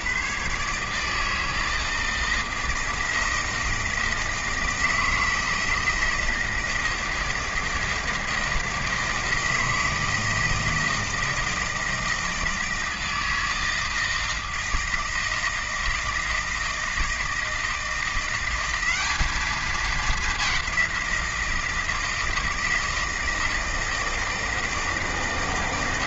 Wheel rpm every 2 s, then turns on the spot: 150, 160, 170, 160, 160, 160, 160, 160, 160, 190, 190, 160, 160.
none